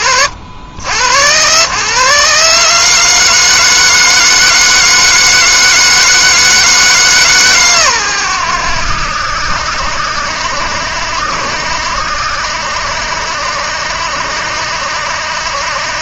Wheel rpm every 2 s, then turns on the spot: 60, 150, 160, 150, 80, 70, 70, 70.
none